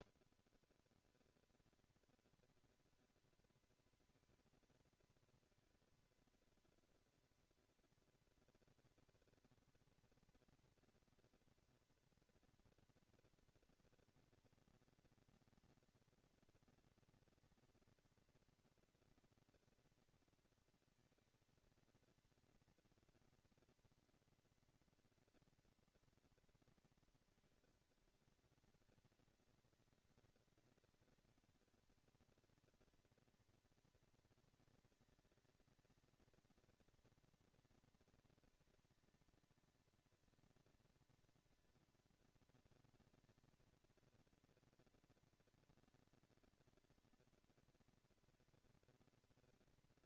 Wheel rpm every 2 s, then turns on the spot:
150, 230, 230, 230, 230, 230, 230, 230, 240, 230, 230, 230, 240, 230, 210, 200, 220, 230, 230, 230, 230, 230, 230, 230, 230.
none